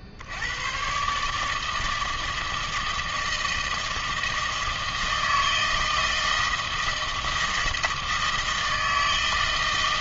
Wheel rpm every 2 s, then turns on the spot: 50, 160, 160, 160, 160.
none